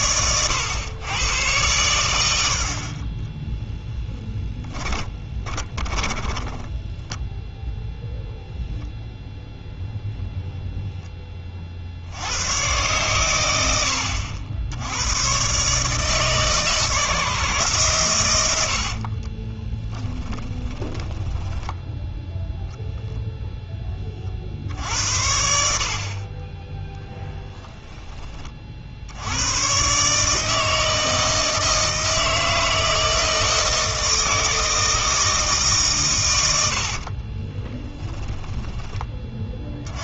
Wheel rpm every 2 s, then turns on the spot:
110, 60, 10, 10, 0, 0, 110, 80, 160, 90, 10, 0, 60, 20, 40, 160, 160, 160, 80, 20.
4-8 20-22 36-38